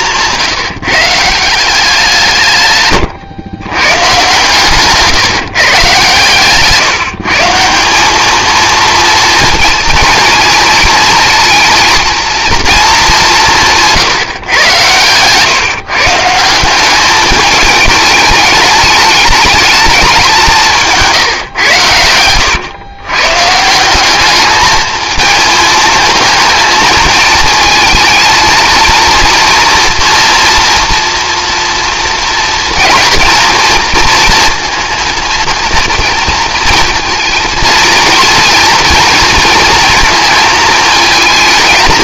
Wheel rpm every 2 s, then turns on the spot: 160, 130, 140, 150, 230, 230, 220, 120, 190, 210, 160, 120, 220, 220, 230, 230, 230, 230, 220, 230, 220.
none